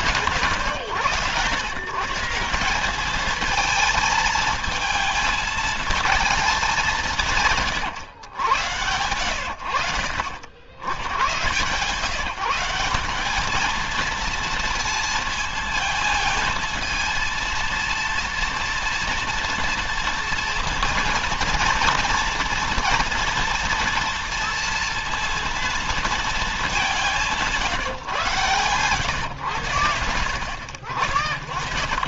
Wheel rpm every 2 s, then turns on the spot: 130, 180, 220, 200, 110, 80, 180, 230, 230, 230, 230, 230, 230, 210, 120, 70.
none